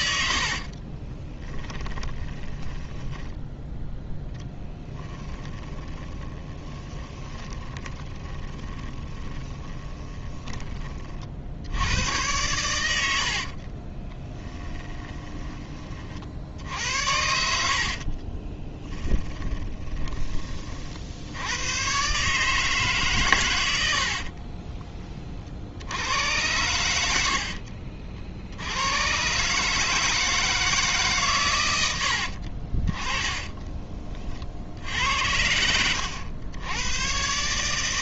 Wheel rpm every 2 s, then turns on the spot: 30, 10, 10, 20, 20, 30, 90, 20, 80, 10, 60, 140, 30, 90, 100, 150, 30, 70, 110.
0-10 14-16 18-20 32-34